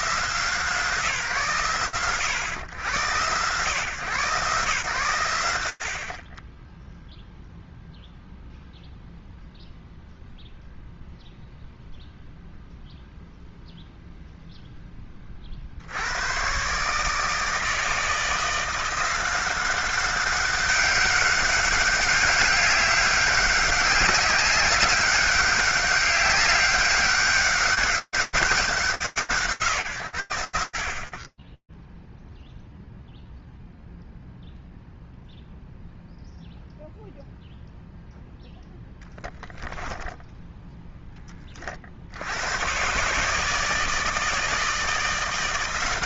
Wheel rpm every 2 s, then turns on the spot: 130, 130, 30, 0, 0, 0, 0, 30, 150, 180, 200, 200, 200, 200, 170, 20, 0, 0, 0, 0, 20, 150, 170.
none